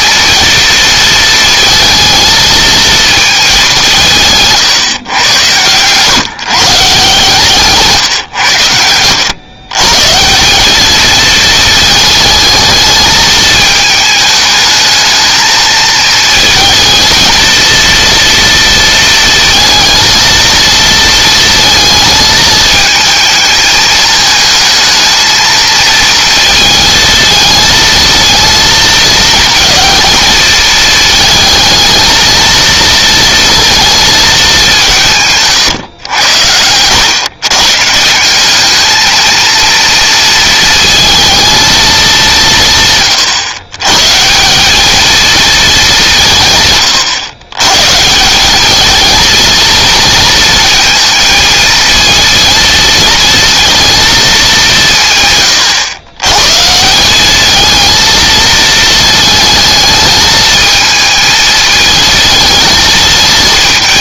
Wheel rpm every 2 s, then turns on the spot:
230, 220, 140, 150, 100, 200, 220, 220, 230, 230, 220, 220, 220, 220, 220, 220, 230, 190, 90, 200, 230, 150, 200, 130, 210, 230, 230, 180, 150, 220, 220, 220.
none